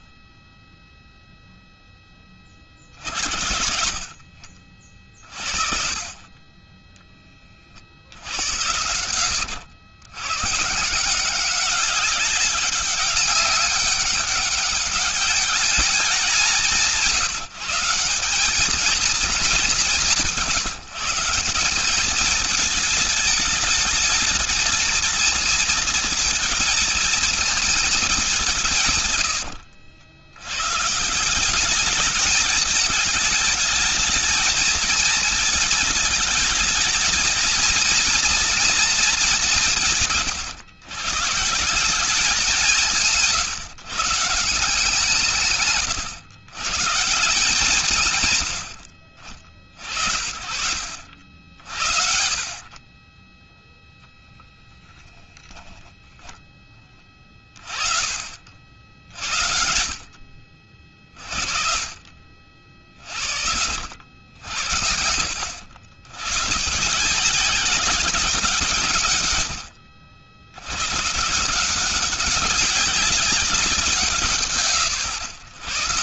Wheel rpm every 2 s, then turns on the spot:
30, 30, 50, 30, 70, 90, 200, 200, 190, 190, 180, 210, 220, 230, 200, 100, 220, 220, 220, 240, 150, 190, 160, 140, 110, 70, 50, 10, 20, 40, 60, 50, 70, 120, 180, 90, 190, 150.
none